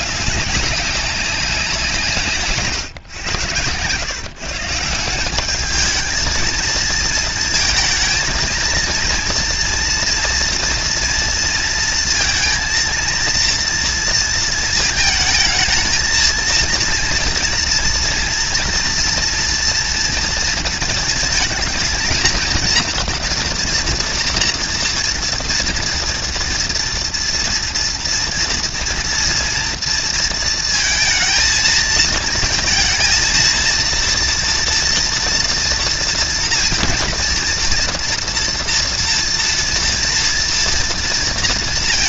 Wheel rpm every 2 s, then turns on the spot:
200, 130, 170, 220, 230, 230, 230, 220, 230, 230, 220, 230, 230, 230, 240, 230, 230, 240, 230, 240, 230.
none